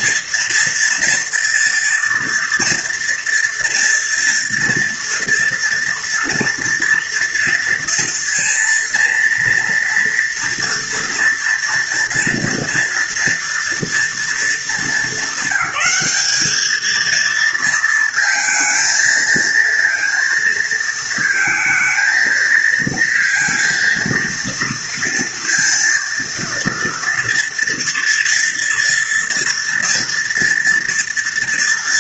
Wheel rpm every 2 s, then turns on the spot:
230, 230, 230, 230, 230, 230, 230, 220, 220, 220, 220, 230, 230, 230, 230, 230.
none